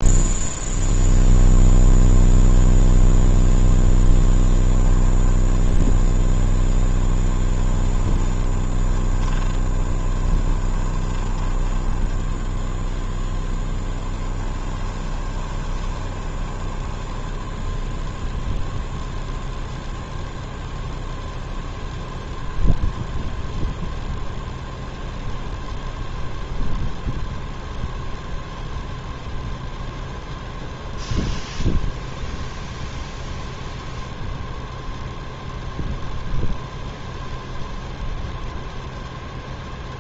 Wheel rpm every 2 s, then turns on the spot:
0, 0, 10, 10, 20, 20, 0, 20, 10, 0, 0, 0, 0, 0, 0, 0, 0, 0, 0, 0.
4-6 8-12 14-18